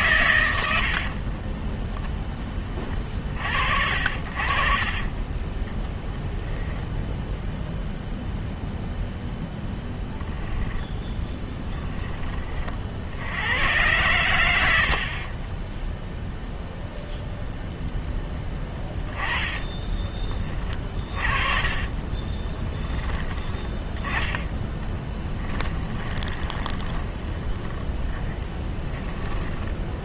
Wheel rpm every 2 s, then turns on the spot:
110, 20, 40, 0, 0, 10, 40, 90, 0, 10, 30, 20, 10, 20, 10.
0-2 14-16 18-30